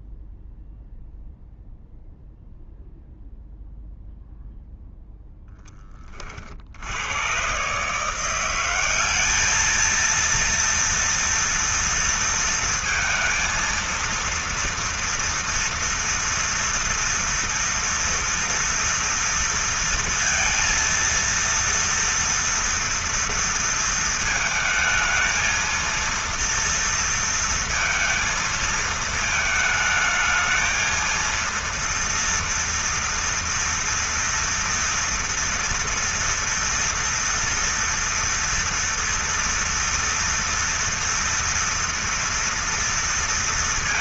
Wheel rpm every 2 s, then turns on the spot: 0, 0, 0, 80, 190, 230, 230, 230, 240, 240, 230, 230, 220, 230, 220, 230, 230, 230, 230, 240, 230, 230.
none